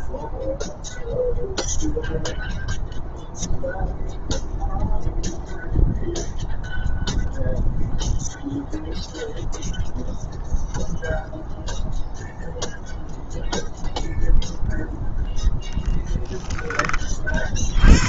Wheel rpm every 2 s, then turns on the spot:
0, 0, 0, 0, 0, 0, 0, 0, 20.
none